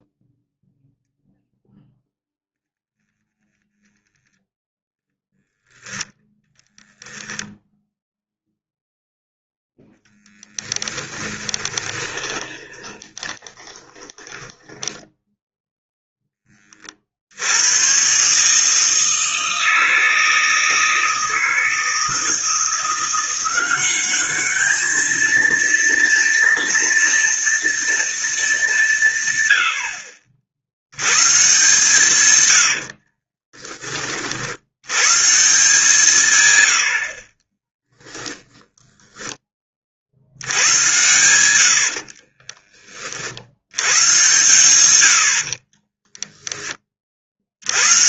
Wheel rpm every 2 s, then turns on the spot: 0, 0, 0, 10, 0, 10, 20, 10, 20, 150, 160, 170, 210, 230, 200, 80, 100, 70, 110, 10, 90, 30, 110, 20.
6-8 10-16 32-34 42-44